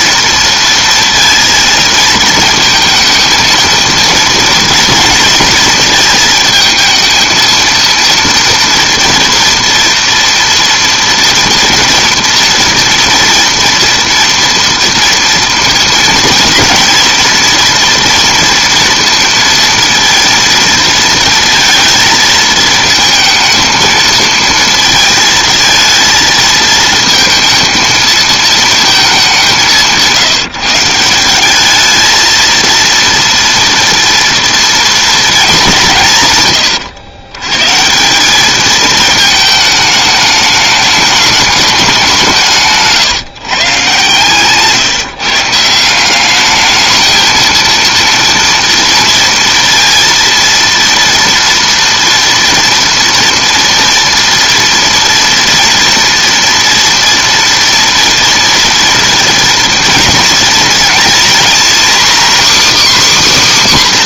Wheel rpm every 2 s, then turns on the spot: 230, 220, 230, 220, 230, 230, 230, 230, 240, 230, 230, 220, 230, 220, 220, 170, 230, 240, 80, 220, 210, 150, 140, 210, 230, 230, 240, 230, 230, 230, 230, 290.
none